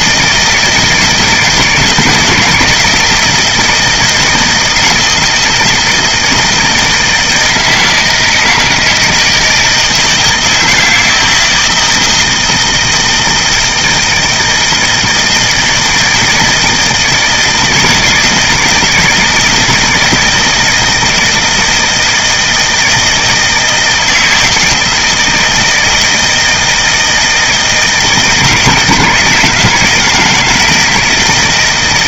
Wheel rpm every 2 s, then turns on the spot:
160, 170, 160, 160, 160, 160, 160, 160, 160, 160, 160, 160, 160, 160, 160, 160.
none